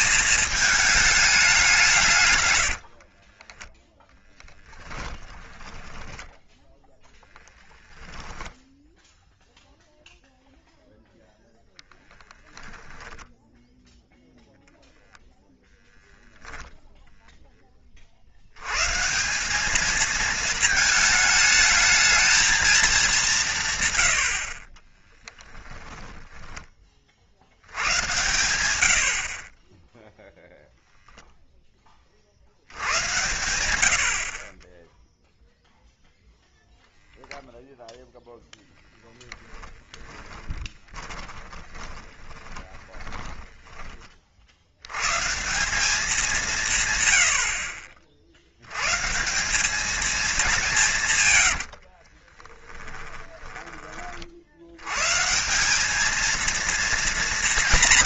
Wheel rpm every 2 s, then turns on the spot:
210, 70, 10, 10, 10, 0, 0, 0, 0, 140, 220, 220, 30, 20, 80, 0, 80, 20, 0, 10, 20, 10, 100, 150, 120, 180, 10, 100, 230.
2-10 24-26 40-44 52-54